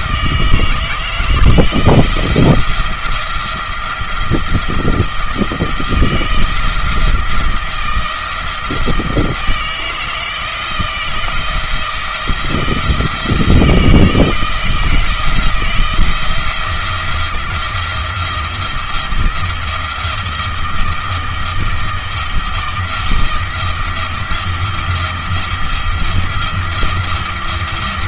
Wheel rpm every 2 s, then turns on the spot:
160, 170, 170, 160, 170, 170, 170, 170, 170, 170, 170, 160, 160, 170.
none